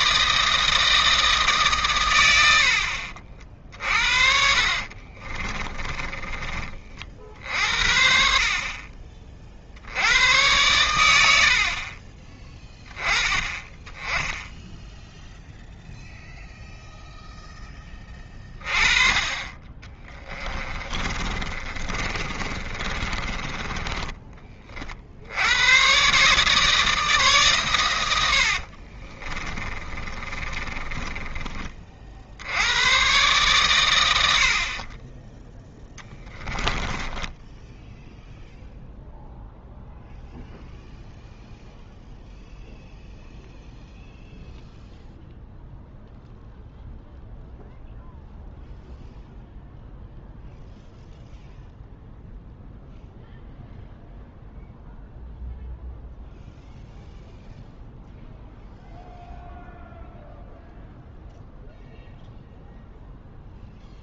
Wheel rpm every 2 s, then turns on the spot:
160, 70, 50, 40, 40, 100, 10, 0, 0, 30, 30, 30, 40, 150, 40, 30, 110, 20, 10, 0, 0, 0, 0, 0, 0, 0, 0, 0, 0, 0, 0, 0.
4-6 20-24 28-32 36-38